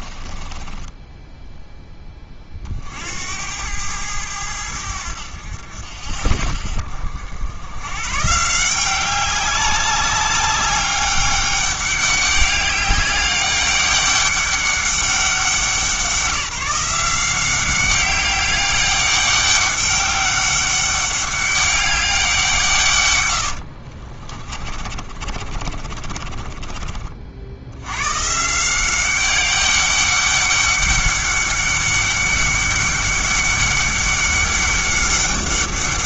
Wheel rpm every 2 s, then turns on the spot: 20, 50, 90, 60, 170, 200, 200, 200, 180, 200, 200, 150, 30, 40, 170, 200, 200, 200.
0-2 24-28